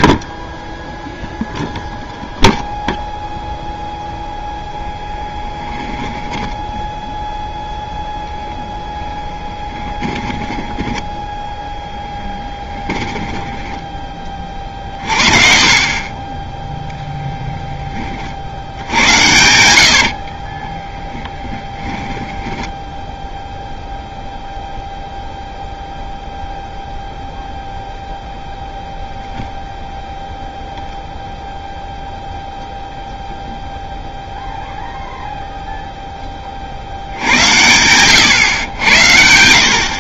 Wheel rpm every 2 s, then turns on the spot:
10, 0, 0, 10, 0, 10, 10, 40, 0, 70, 20, 10, 0, 0, 0, 0, 0, 0, 40, 100.
10-16 18-24